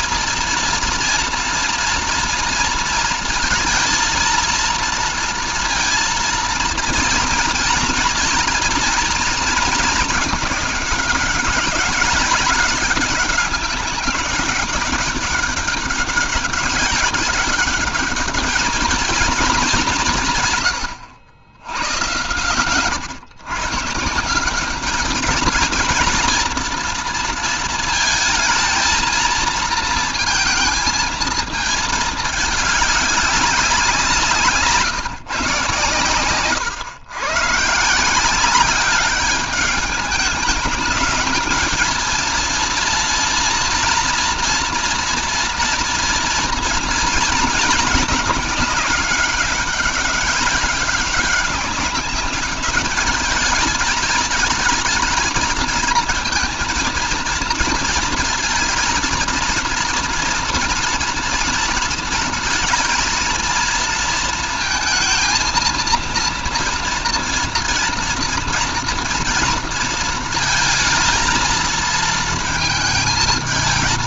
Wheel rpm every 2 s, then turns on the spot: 230, 230, 230, 230, 230, 200, 200, 200, 190, 220, 120, 120, 200, 230, 220, 220, 200, 150, 110, 200, 210, 230, 240, 230, 210, 200, 210, 220, 230, 230, 230, 230, 230, 240, 240, 230, 220.
none